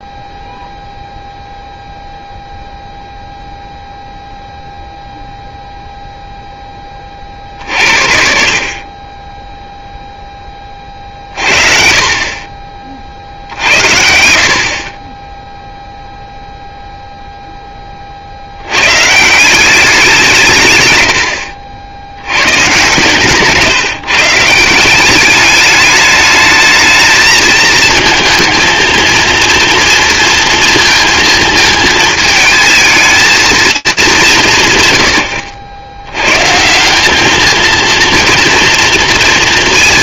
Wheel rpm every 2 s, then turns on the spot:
0, 0, 0, 20, 40, 30, 50, 30, 0, 110, 130, 140, 180, 220, 230, 230, 220, 100, 190, 230.
none